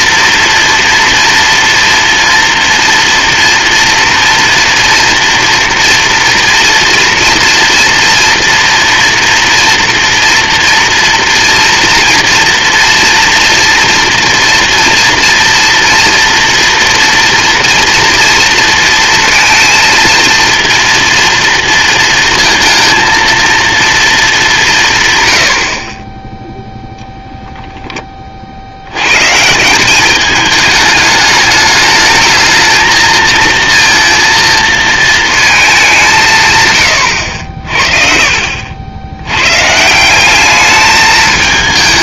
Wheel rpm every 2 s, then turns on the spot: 230, 230, 230, 230, 230, 230, 230, 240, 230, 230, 230, 230, 170, 0, 60, 210, 220, 230, 160, 60, 200.
none